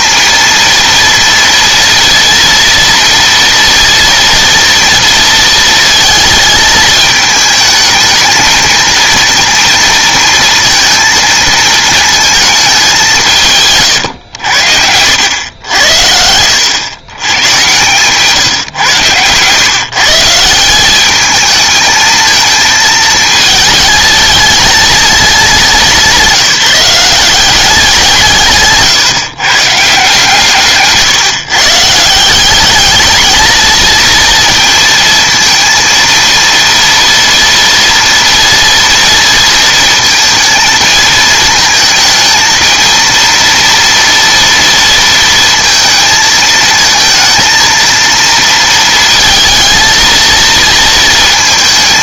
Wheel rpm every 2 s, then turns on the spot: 230, 230, 230, 220, 220, 230, 210, 90, 90, 140, 170, 220, 220, 180, 150, 150, 200, 230, 230, 230, 220, 220, 230, 220, 230, 230.
14-16